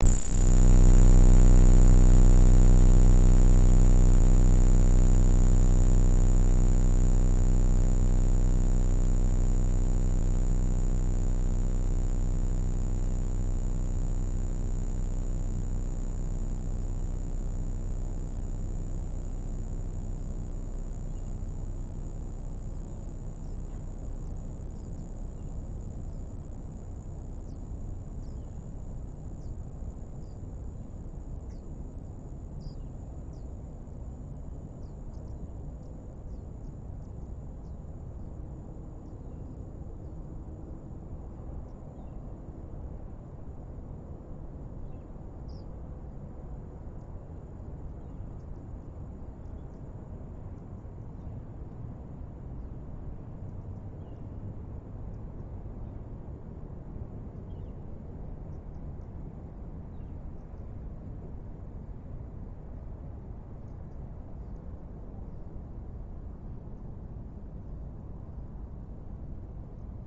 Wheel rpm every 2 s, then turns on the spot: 0, 0, 0, 0, 0, 0, 0, 0, 0, 0, 0, 0, 0, 0, 0, 0, 0, 0, 0, 0, 0, 0, 0, 0, 0, 0, 0, 0, 0, 0, 0, 0, 0, 0, 0.
none